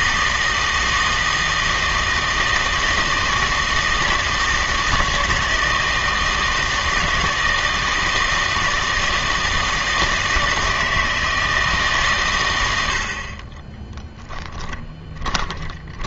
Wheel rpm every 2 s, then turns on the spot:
160, 160, 160, 160, 160, 160, 90, 20.
14-16